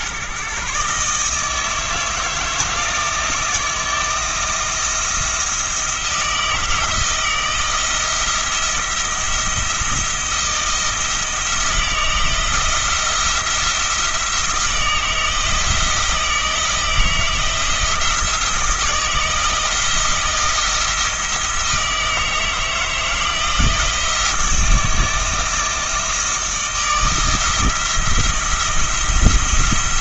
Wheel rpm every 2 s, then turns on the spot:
140, 160, 160, 160, 170, 170, 170, 160, 170, 160, 160, 160, 160, 160, 170.
none